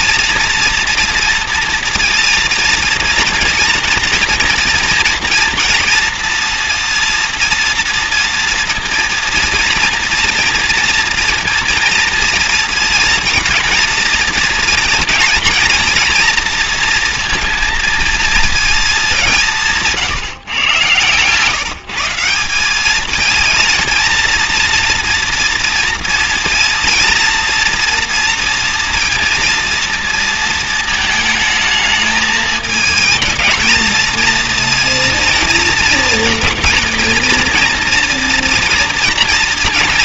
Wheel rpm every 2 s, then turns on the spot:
230, 230, 240, 230, 230, 230, 230, 230, 230, 220, 120, 200, 240, 230, 230, 220, 220, 230, 230, 230.
none